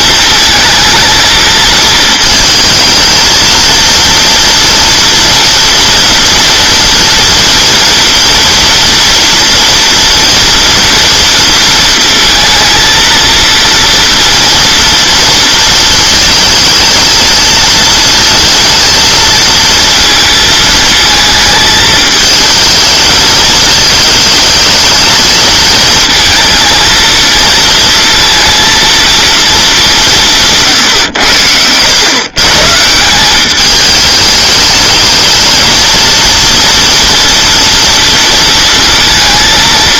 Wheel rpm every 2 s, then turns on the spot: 220, 220, 240, 230, 230, 230, 230, 230, 220, 230, 220, 220, 220, 220, 230, 140, 160, 210, 240, 230.
none